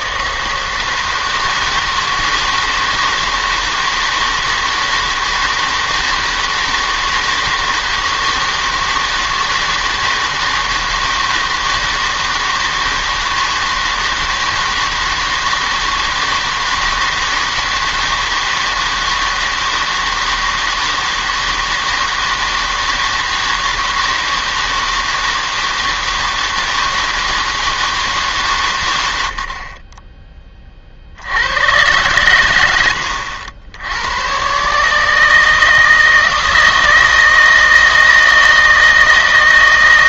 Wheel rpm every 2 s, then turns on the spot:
160, 160, 160, 160, 160, 160, 160, 160, 160, 160, 160, 160, 160, 160, 140, 20, 110, 130, 160, 160.
none